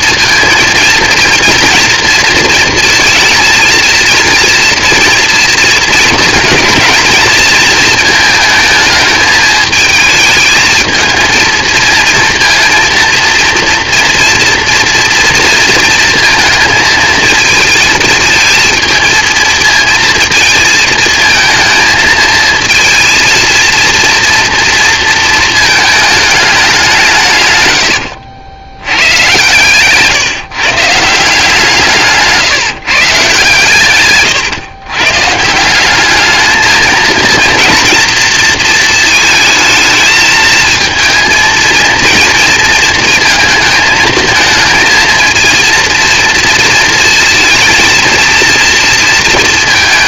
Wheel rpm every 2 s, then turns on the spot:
230, 230, 230, 230, 220, 220, 230, 230, 230, 220, 220, 230, 230, 200, 100, 150, 150, 130, 220, 230, 220, 230, 220, 230, 230.
none